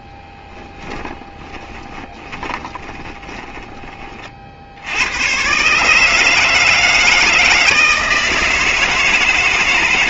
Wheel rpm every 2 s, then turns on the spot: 10, 20, 60, 160, 160.
0-4